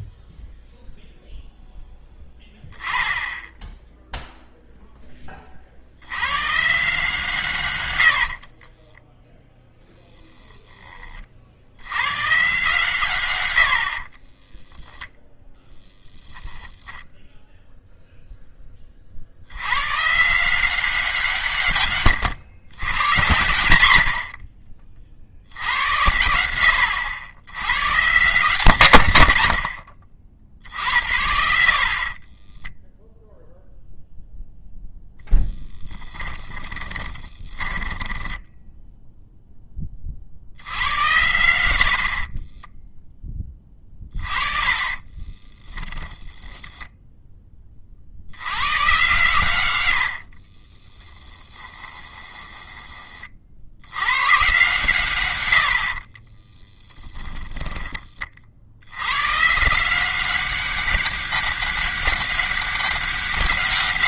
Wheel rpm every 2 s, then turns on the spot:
0, 10, 0, 140, 40, 20, 150, 10, 0, 10, 170, 100, 30, 90, 140, 50, 10, 0, 30, 10, 80, 20, 30, 10, 110, 20, 20, 130, 10, 90, 200, 200.
8-12 14-16 32-34 36-40 42-46 50-54 56-58